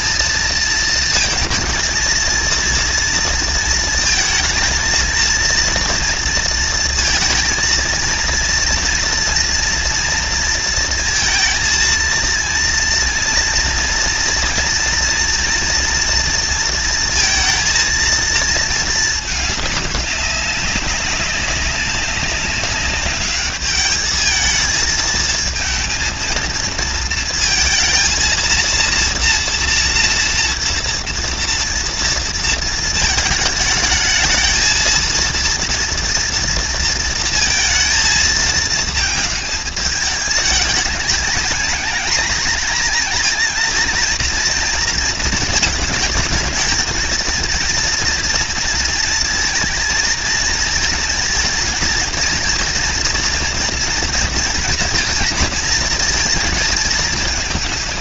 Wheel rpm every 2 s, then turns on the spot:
220, 230, 230, 230, 230, 230, 230, 230, 230, 220, 200, 200, 220, 230, 230, 240, 230, 220, 230, 230, 210, 230, 230, 220, 230, 230, 230, 230, 220.
none